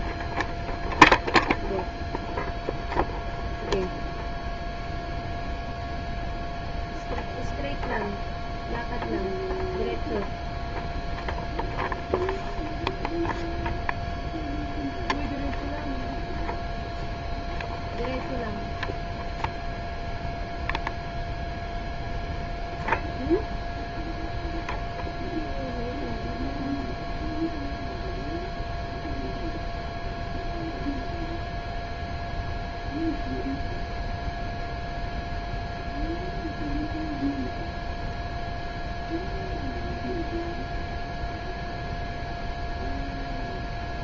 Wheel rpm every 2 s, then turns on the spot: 0, 0, 0, 0, 0, 0, 0, 0, 0, 0, 0, 0, 0, 0, 0, 0, 0, 0, 0, 0, 0, 0.
none